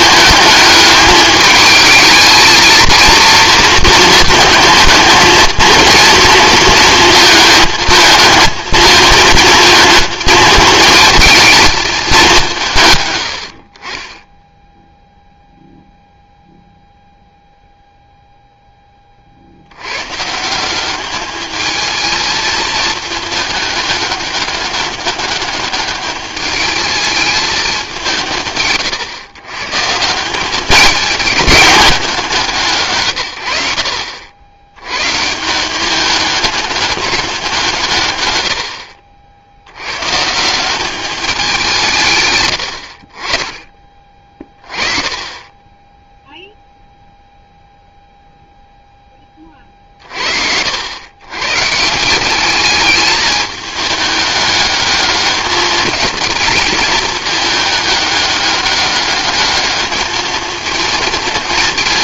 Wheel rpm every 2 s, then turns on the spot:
210, 220, 220, 230, 220, 220, 170, 10, 0, 10, 180, 220, 200, 210, 140, 200, 160, 100, 200, 100, 180, 100, 30, 0, 0, 70, 200, 210, 220, 200, 220.
42-44